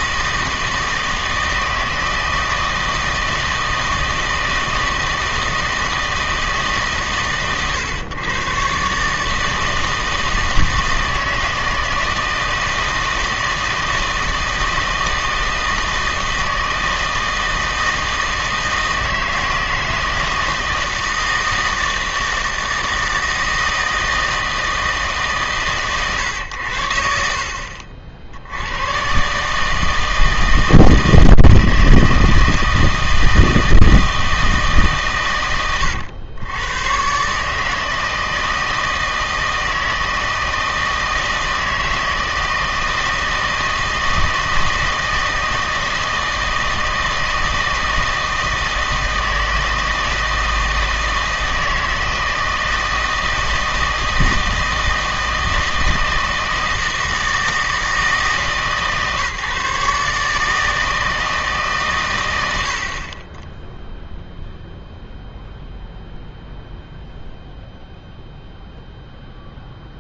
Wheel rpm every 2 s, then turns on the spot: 160, 160, 160, 150, 130, 160, 160, 160, 160, 160, 160, 160, 160, 80, 100, 160, 160, 150, 110, 160, 160, 160, 160, 160, 160, 160, 160, 160, 160, 150, 160, 80, 0, 0, 0.
none